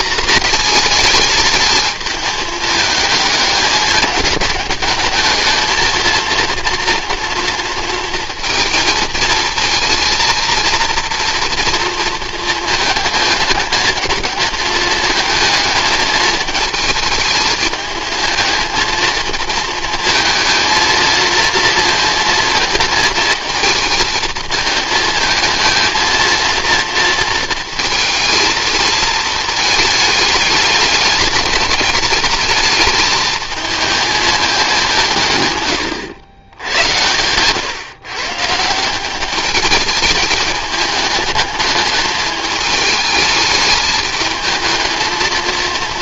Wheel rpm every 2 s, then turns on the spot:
220, 220, 220, 230, 230, 230, 220, 220, 220, 230, 230, 220, 220, 230, 220, 220, 220, 190, 100, 170, 210, 210, 220.
none